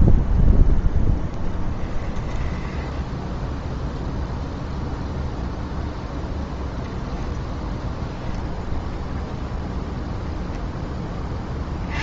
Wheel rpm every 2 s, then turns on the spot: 0, 10, 0, 0, 0, 10.
2-4